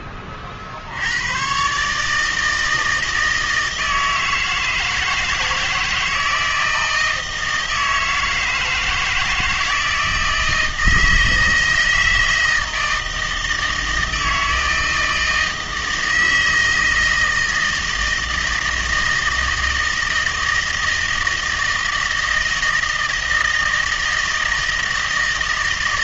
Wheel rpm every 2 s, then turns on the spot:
50, 160, 160, 160, 160, 160, 160, 160, 160, 160, 160, 160, 160.
none